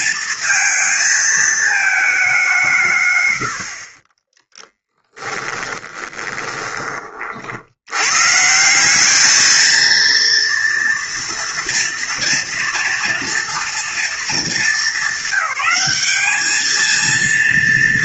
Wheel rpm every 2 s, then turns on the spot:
230, 170, 10, 20, 170, 230, 230, 210, 210.
4-8